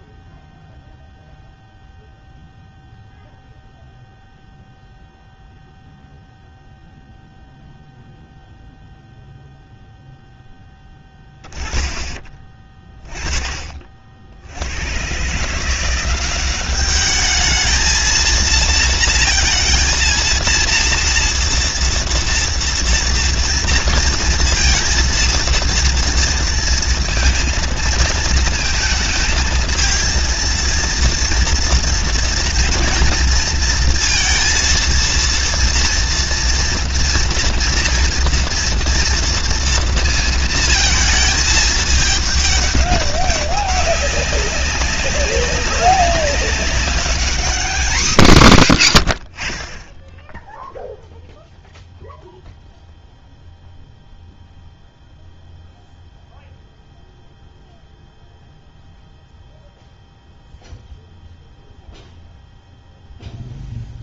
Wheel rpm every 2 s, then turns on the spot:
0, 0, 0, 0, 0, 10, 30, 100, 200, 230, 240, 230, 230, 230, 220, 230, 230, 230, 230, 230, 220, 200, 190, 200, 140, 0, 0, 0, 0, 0, 0, 0.
none